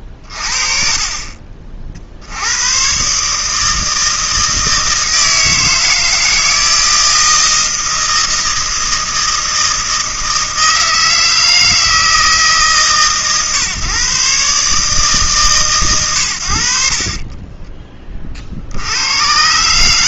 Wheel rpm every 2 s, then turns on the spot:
30, 90, 160, 160, 160, 160, 150, 140, 90, 50.
none